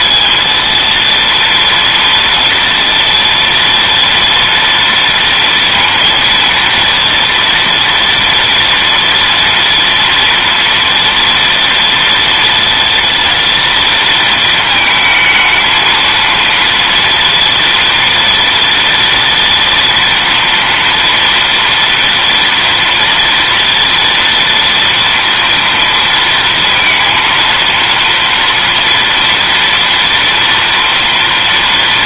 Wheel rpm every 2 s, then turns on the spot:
230, 240, 230, 230, 230, 230, 230, 220, 230, 230, 230, 230, 230, 230, 240, 230.
none